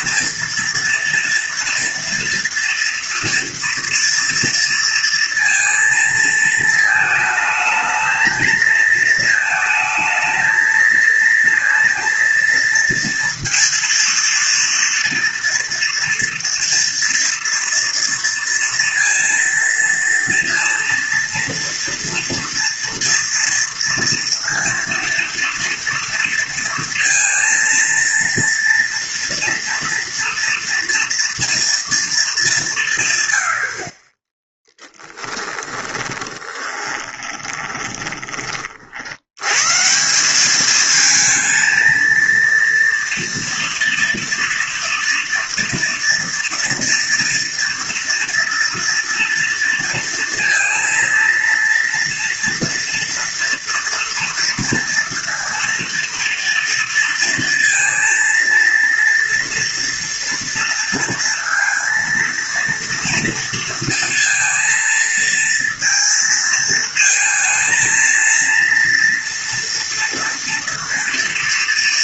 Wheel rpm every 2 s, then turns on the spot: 230, 230, 230, 220, 220, 220, 230, 230, 230, 230, 230, 230, 230, 230, 230, 230, 190, 10, 30, 40, 210, 230, 230, 230, 230, 230, 230, 230, 230, 230, 230, 230, 230, 230, 230, 230.
34-38